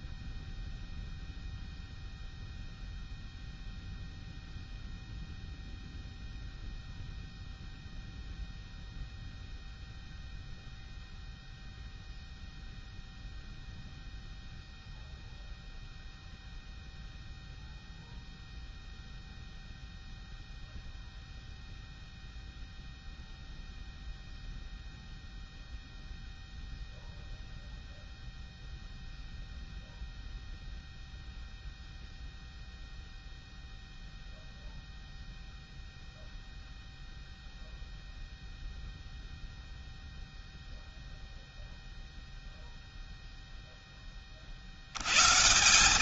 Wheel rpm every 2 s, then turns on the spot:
0, 0, 0, 0, 0, 0, 0, 0, 0, 0, 0, 0, 0, 0, 0, 0, 0, 0, 0, 0, 0, 0, 60.
none